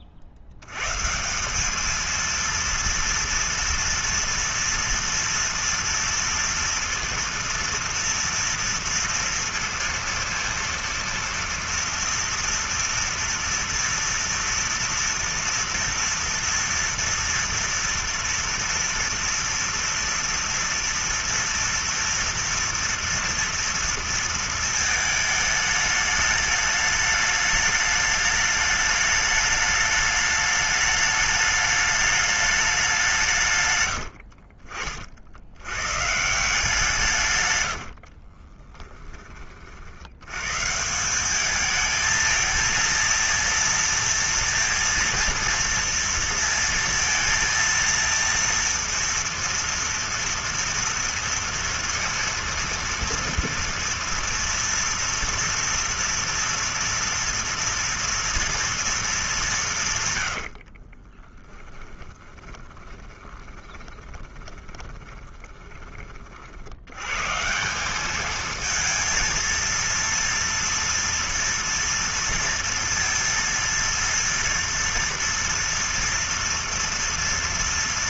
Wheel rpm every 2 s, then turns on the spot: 100, 230, 230, 230, 230, 230, 240, 230, 230, 230, 230, 230, 220, 210, 210, 210, 200, 50, 160, 20, 150, 230, 230, 230, 230, 230, 230, 230, 230, 230, 70, 40, 30, 80, 220, 230, 230, 230, 230.
38-40 60-66